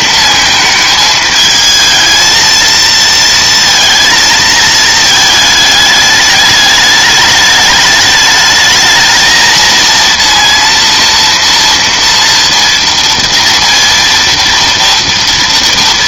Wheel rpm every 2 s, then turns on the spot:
220, 230, 220, 210, 220, 230, 230, 230.
none